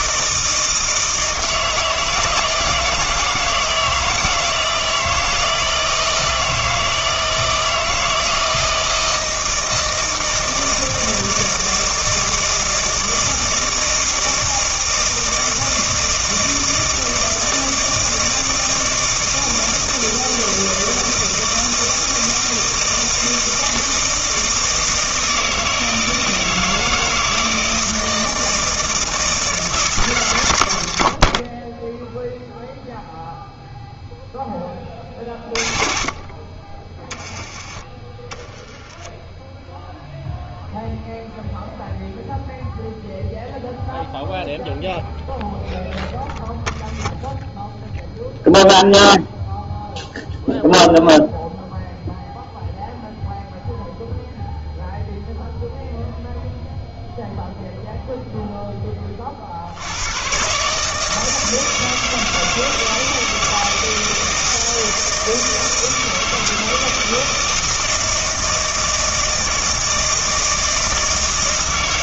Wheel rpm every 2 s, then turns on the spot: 160, 160, 160, 160, 160, 160, 160, 160, 160, 160, 160, 160, 160, 160, 160, 90, 0, 30, 30, 10, 0, 0, 0, 0, 0, 0, 0, 0, 0, 10, 150, 160, 160, 160, 160, 160.
none